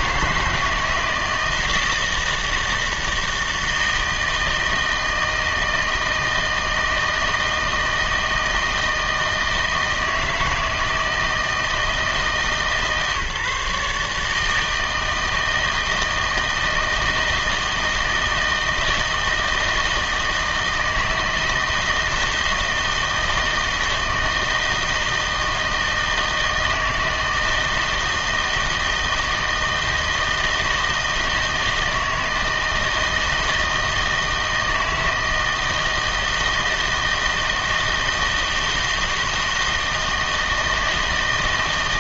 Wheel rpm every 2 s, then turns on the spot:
160, 160, 160, 160, 160, 160, 140, 160, 160, 160, 160, 160, 160, 160, 160, 160, 160, 160, 160, 160, 160.
none